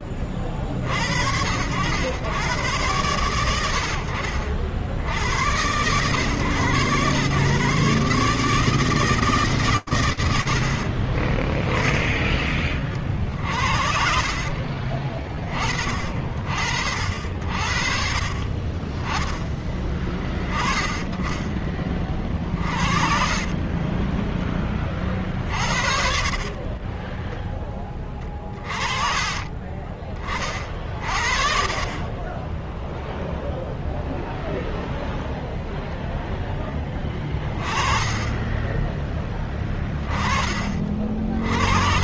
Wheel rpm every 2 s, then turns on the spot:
80, 100, 90, 120, 150, 20, 60, 40, 50, 20, 30, 30, 50, 10, 30, 40, 0, 0, 30, 10, 70.
28-30